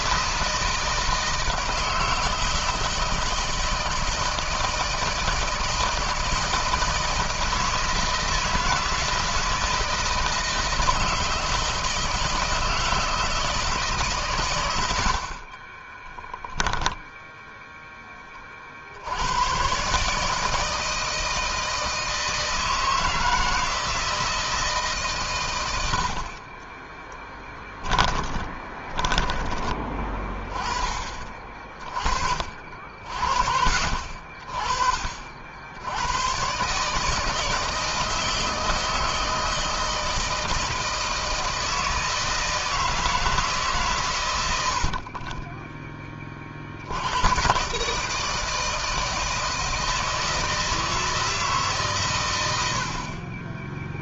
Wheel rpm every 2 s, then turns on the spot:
160, 160, 160, 160, 160, 170, 160, 90, 10, 50, 160, 160, 150, 10, 20, 30, 60, 50, 150, 160, 160, 160, 60, 80, 160, 160, 60.
14-18 26-30